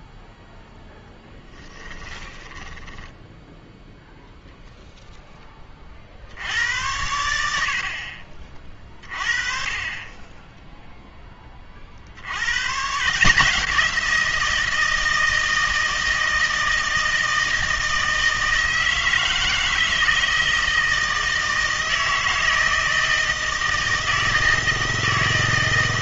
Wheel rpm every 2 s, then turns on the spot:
0, 10, 0, 90, 30, 0, 140, 170, 160, 160, 160, 160, 160.
2-4